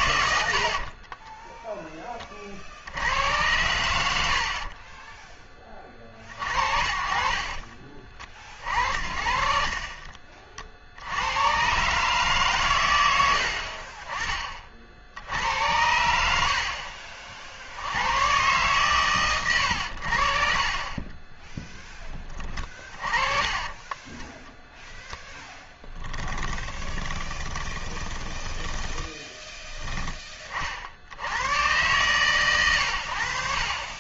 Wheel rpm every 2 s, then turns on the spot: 40, 90, 30, 40, 60, 80, 100, 60, 50, 130, 30, 30, 10, 20, 10, 60, 100.
0-2 4-6 8-10 26-30